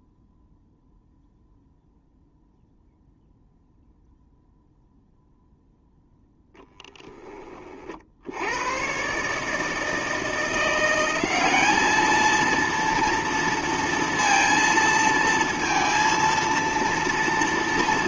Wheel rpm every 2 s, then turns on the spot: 0, 0, 0, 10, 100, 170, 230, 230, 230.
none